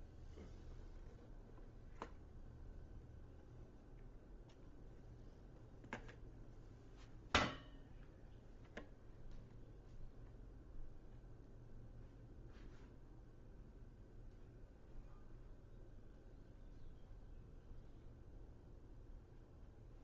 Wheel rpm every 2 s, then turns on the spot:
0, 0, 0, 0, 0, 0, 0, 0, 0, 0.
none